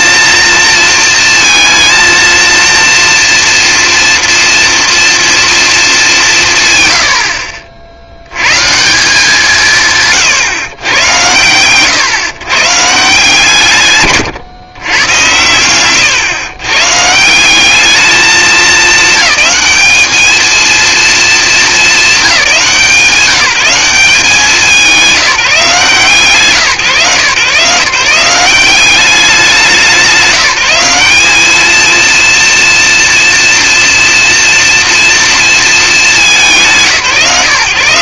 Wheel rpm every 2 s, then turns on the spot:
230, 230, 230, 120, 150, 80, 160, 120, 140, 210, 230, 170, 180, 150, 190, 180, 230, 230, 160.
6-8